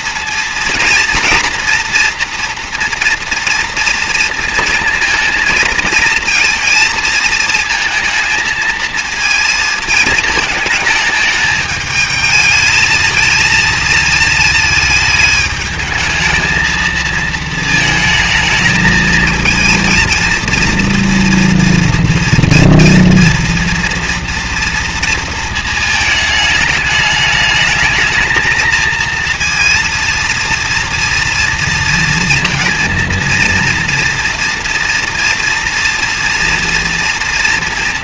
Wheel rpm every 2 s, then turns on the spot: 230, 240, 230, 230, 230, 220, 220, 220, 220, 220, 230, 230, 230, 210, 230, 230, 230, 230, 230.
none